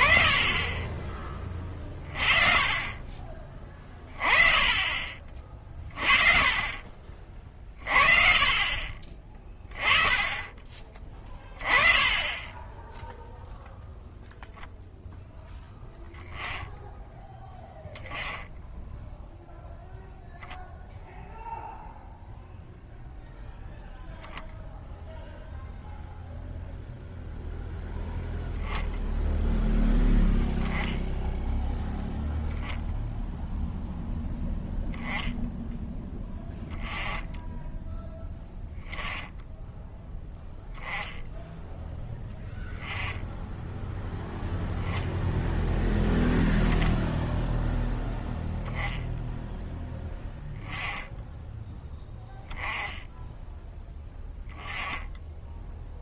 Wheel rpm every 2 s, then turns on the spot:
20, 30, 30, 40, 30, 20, 10, 0, 10, 0, 0, 0, 0, 0, 0, 0, 0, 0, 10, 10, 0, 10, 0, 0, 0, 10, 10, 10.
none